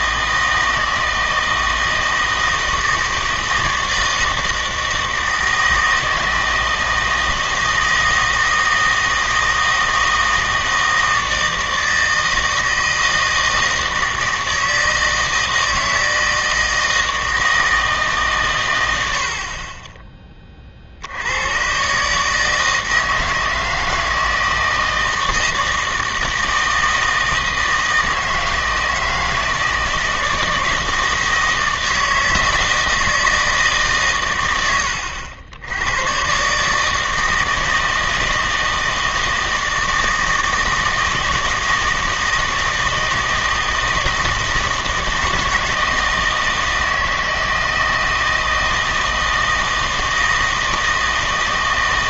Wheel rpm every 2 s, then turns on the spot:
160, 160, 160, 160, 160, 160, 160, 160, 160, 110, 40, 160, 160, 160, 160, 160, 160, 90, 140, 160, 160, 160, 160, 160, 160, 160.
none